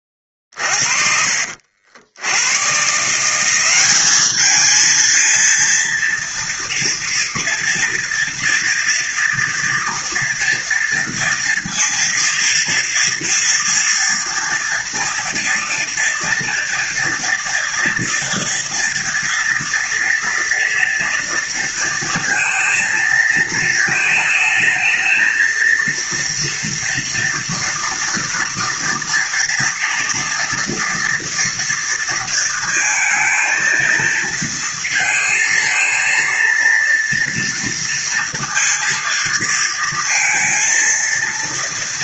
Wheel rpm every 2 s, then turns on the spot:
40, 100, 210, 230, 230, 230, 240, 230, 240, 230, 230, 230, 220, 230, 230, 230, 230, 230, 230, 230, 230.
none